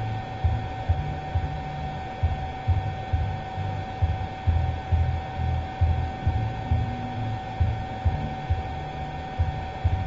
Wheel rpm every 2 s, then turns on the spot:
0, 0, 0, 0, 0.
none